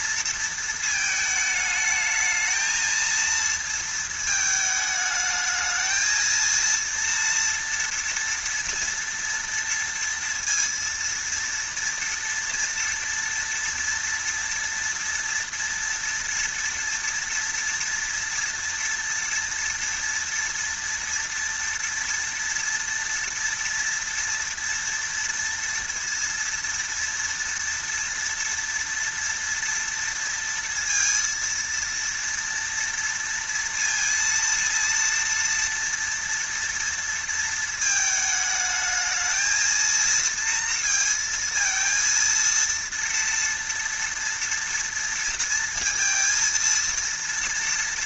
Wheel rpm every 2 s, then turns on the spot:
220, 220, 220, 230, 240, 230, 230, 230, 240, 230, 230, 230, 230, 230, 230, 230, 230, 230, 230, 220, 230, 230, 230, 230.
none